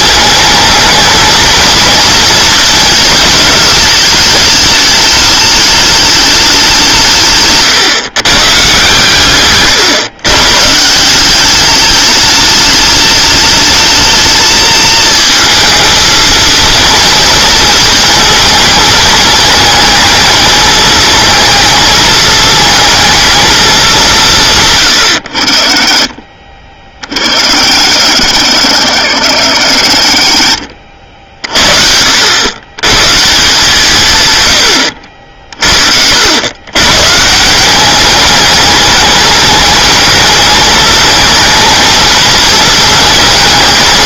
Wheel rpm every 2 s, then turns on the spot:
220, 220, 210, 180, 130, 150, 210, 220, 230, 220, 220, 220, 130, 40, 90, 60, 110, 100, 120, 210, 220, 220.
30-32